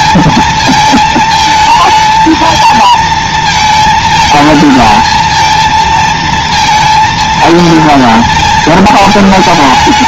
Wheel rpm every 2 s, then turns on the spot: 220, 230, 220, 230, 220.
none